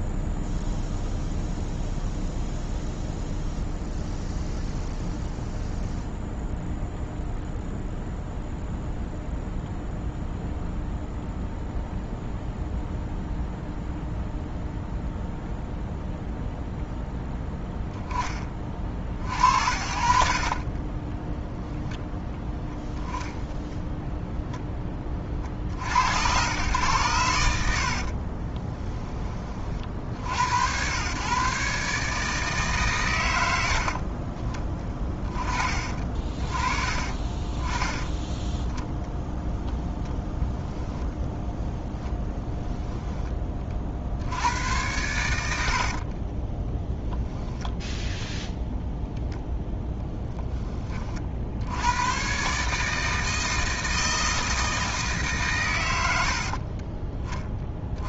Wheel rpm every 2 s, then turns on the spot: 0, 0, 0, 0, 0, 0, 0, 0, 0, 50, 20, 10, 10, 110, 20, 110, 130, 20, 20, 10, 10, 10, 100, 10, 0, 20, 150, 160, 30.
20-24 28-30 40-42 46-48 56-58